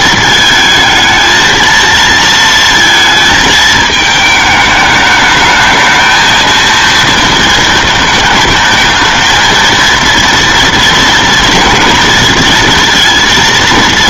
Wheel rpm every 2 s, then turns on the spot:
220, 220, 210, 230, 220, 230, 230.
none